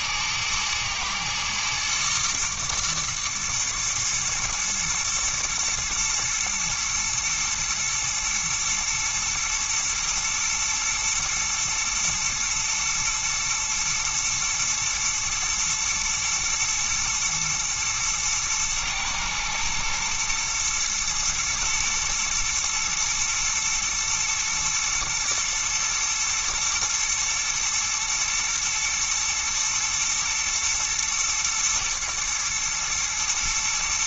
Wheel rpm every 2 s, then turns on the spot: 110, 110, 110, 110, 120, 120, 120, 110, 120, 110, 120, 110, 120, 120, 120, 110, 120.
none